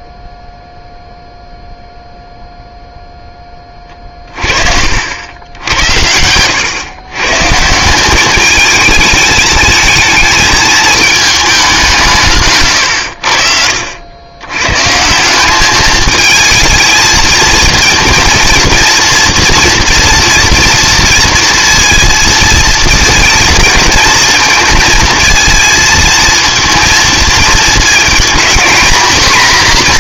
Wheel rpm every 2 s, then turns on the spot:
0, 0, 50, 120, 210, 220, 120, 120, 220, 230, 230, 220, 230, 230, 230.
4-6